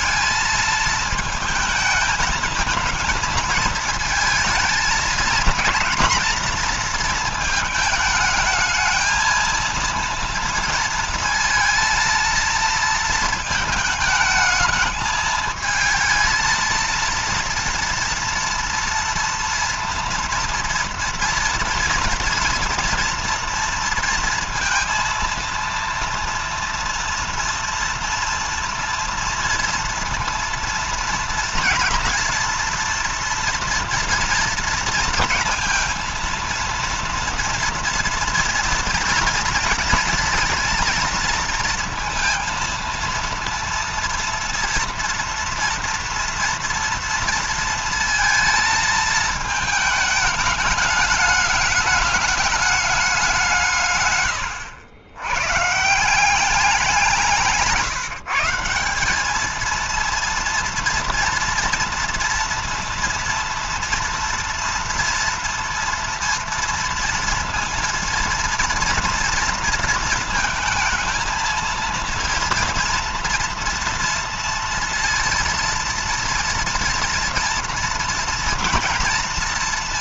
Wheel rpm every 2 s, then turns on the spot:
220, 220, 220, 230, 220, 230, 230, 220, 230, 230, 230, 230, 230, 230, 230, 230, 230, 230, 230, 230, 230, 230, 230, 230, 220, 210, 200, 90, 180, 180, 230, 230, 230, 230, 230, 230, 230, 230, 230, 230.
none